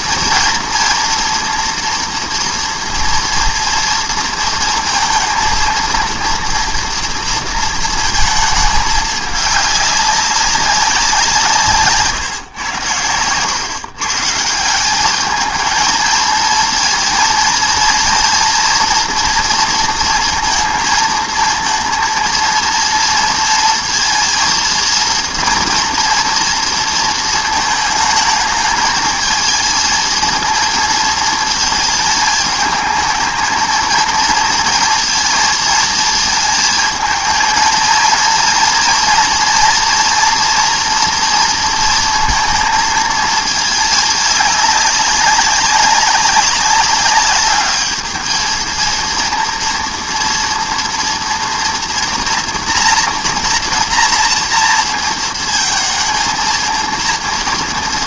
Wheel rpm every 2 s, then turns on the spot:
230, 240, 230, 230, 220, 200, 140, 150, 220, 230, 230, 230, 230, 230, 220, 230, 210, 220, 230, 230, 230, 230, 210, 200, 220, 230, 240, 230, 230.
none